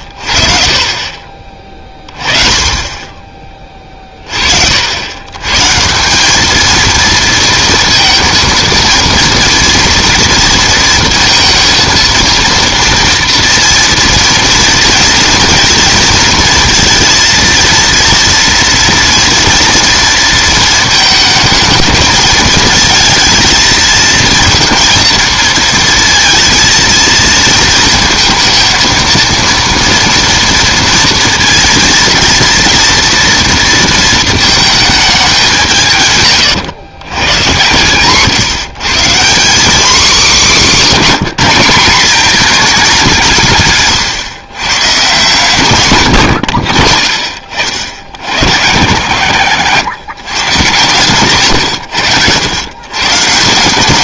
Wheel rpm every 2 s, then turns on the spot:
30, 20, 50, 220, 230, 230, 230, 230, 230, 230, 220, 220, 230, 230, 230, 230, 230, 220, 130, 140, 210, 210, 130, 60, 100, 120, 120.
40-42